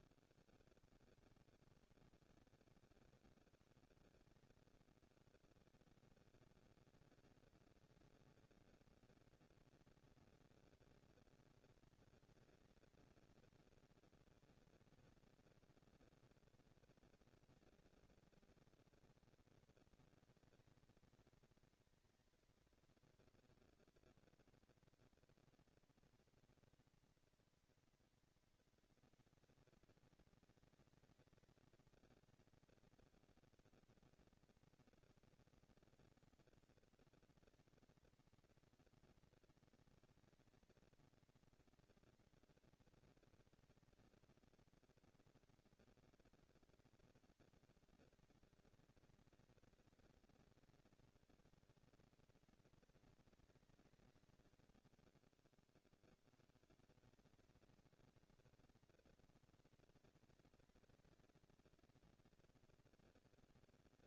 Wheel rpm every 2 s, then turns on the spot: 140, 150, 140, 230, 230, 230, 230, 230, 230, 230, 220, 230, 230, 230, 240, 220, 230, 230, 240, 230, 230, 230, 230, 220, 190, 200, 230, 80, 170, 240, 230, 220.
none